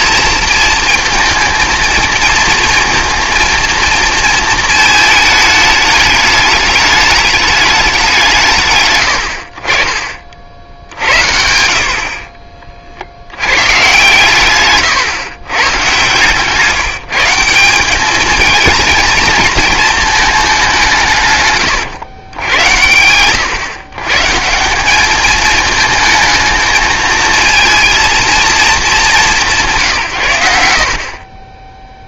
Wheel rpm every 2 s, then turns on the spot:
230, 230, 220, 210, 100, 60, 40, 130, 150, 230, 190, 90, 180, 220, 210, 80.
none